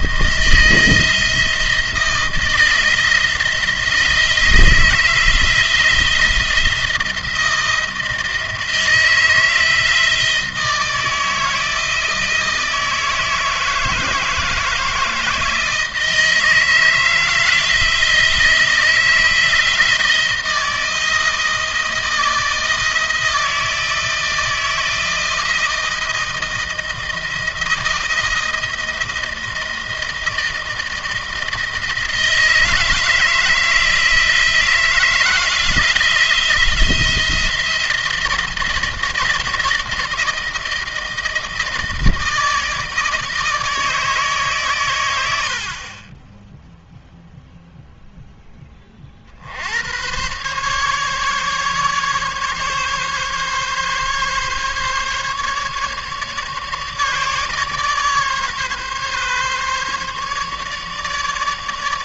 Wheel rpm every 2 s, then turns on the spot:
170, 170, 170, 170, 160, 160, 160, 160, 160, 160, 160, 160, 170, 160, 160, 160, 170, 160, 170, 160, 160, 160, 120, 0, 30, 140, 140, 140, 150, 140, 150.
none